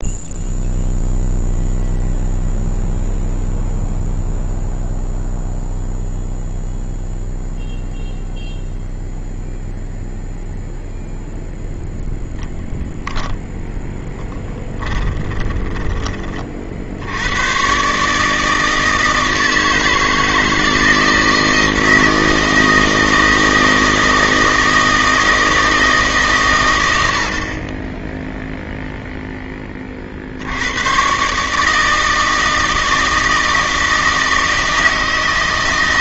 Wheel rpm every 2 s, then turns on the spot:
0, 0, 0, 0, 0, 0, 0, 10, 60, 160, 160, 160, 160, 110, 0, 90, 160, 160.
14-16